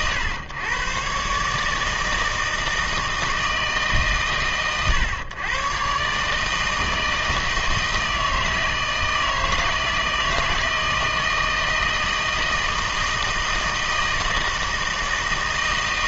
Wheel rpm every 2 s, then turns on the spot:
120, 160, 130, 160, 160, 160, 160, 160.
none